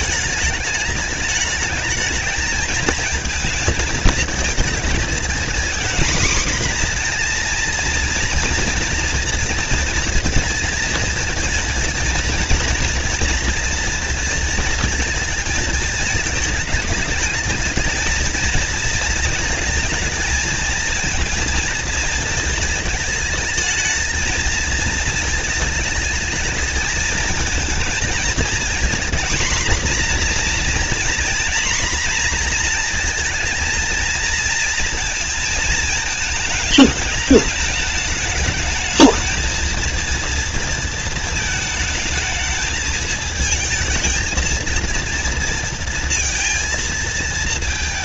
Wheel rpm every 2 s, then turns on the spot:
210, 220, 230, 240, 240, 230, 230, 220, 210, 220, 230, 210, 230, 230, 230, 240, 230, 230, 210, 220, 220, 220, 230, 220.
none